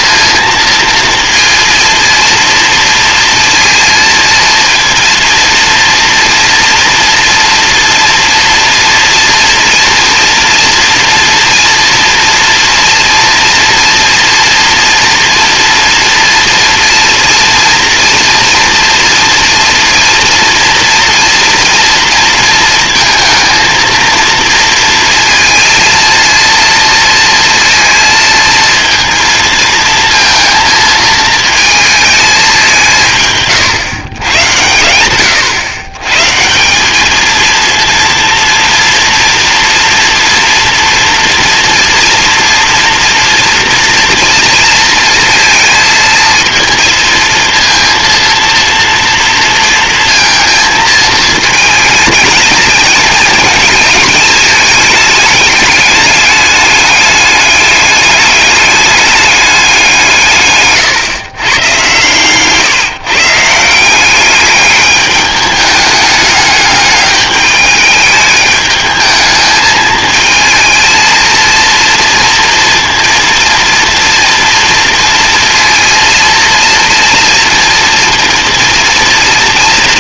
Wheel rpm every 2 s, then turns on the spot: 230, 230, 230, 240, 240, 230, 230, 230, 230, 230, 230, 230, 230, 230, 230, 230, 170, 100, 210, 230, 230, 230, 230, 230, 230, 220, 220, 210, 200, 210, 140, 150, 210, 200, 210, 230, 230, 230, 230, 230.
none